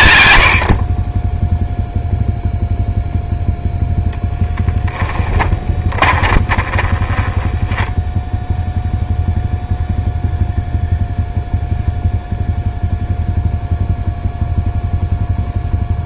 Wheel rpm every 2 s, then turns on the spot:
120, 0, 10, 20, 0, 0, 0, 0.
6-8